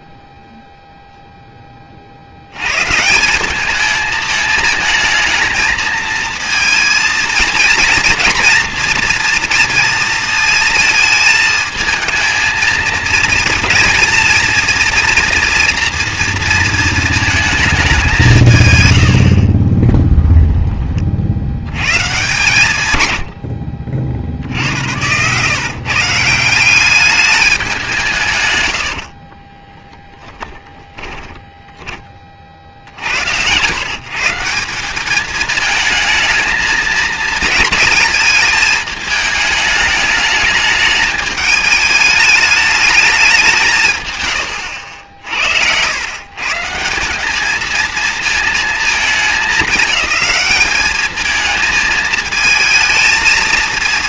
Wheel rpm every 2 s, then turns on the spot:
0, 90, 220, 230, 230, 230, 230, 230, 230, 150, 0, 130, 90, 180, 100, 20, 70, 190, 220, 220, 210, 210, 70, 190, 220, 210, 220.
30-32